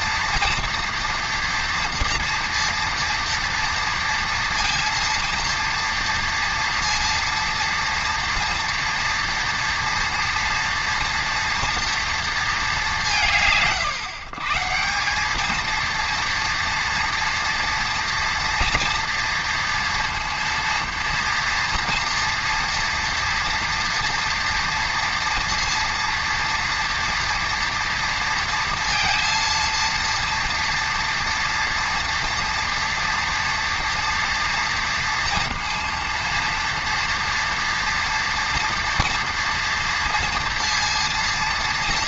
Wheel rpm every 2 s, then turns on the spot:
230, 230, 230, 230, 230, 230, 210, 150, 230, 230, 230, 230, 230, 230, 230, 240, 230, 230, 230, 230, 230.
none